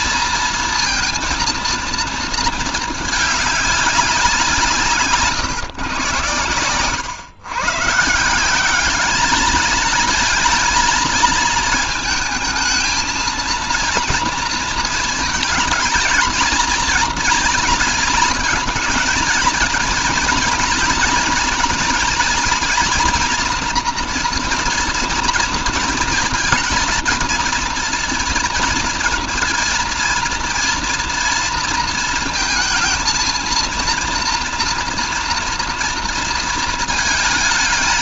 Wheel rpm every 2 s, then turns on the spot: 230, 220, 160, 120, 200, 230, 220, 230, 230, 230, 230, 230, 230, 230, 230, 230, 230, 230, 230.
none